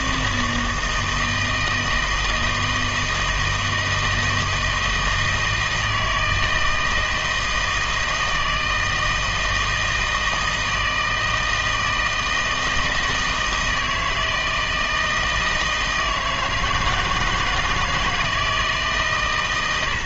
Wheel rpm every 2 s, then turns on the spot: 160, 160, 160, 160, 160, 160, 160, 160, 160, 160.
none